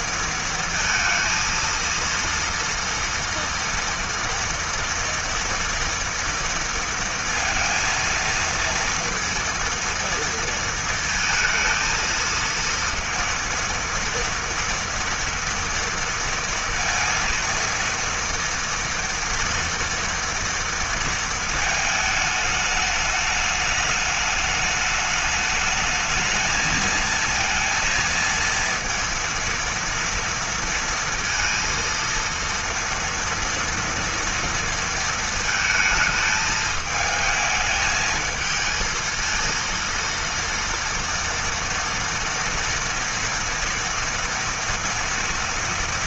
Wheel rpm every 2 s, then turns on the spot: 230, 230, 230, 230, 230, 230, 230, 230, 230, 230, 230, 210, 210, 230, 230, 230, 230, 230, 220, 230, 230, 230, 240.
none